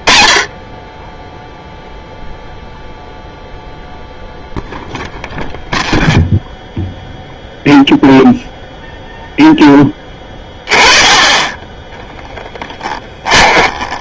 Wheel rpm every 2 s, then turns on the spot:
20, 0, 0, 0, 0, 20, 10.
12-14